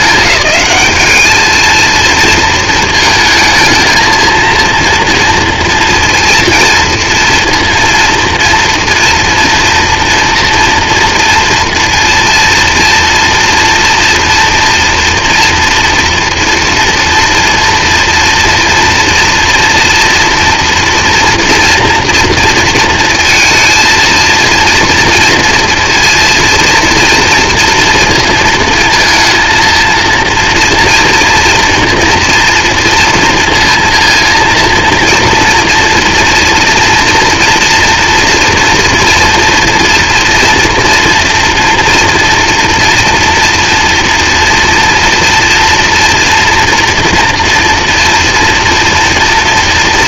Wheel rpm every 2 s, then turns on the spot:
200, 220, 230, 230, 230, 230, 230, 230, 240, 230, 230, 230, 230, 230, 230, 230, 230, 230, 230, 240, 240, 230, 230, 230, 230.
none